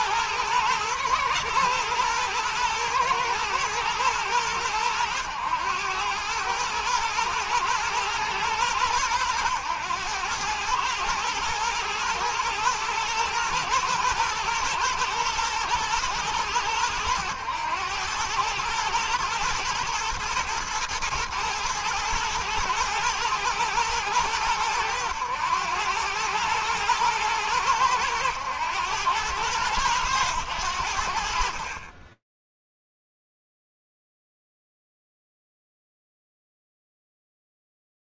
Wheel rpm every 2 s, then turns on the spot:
110, 110, 110, 110, 110, 110, 110, 120, 100, 120, 110, 110, 100, 110, 100, 70, 0, 0, 0.
none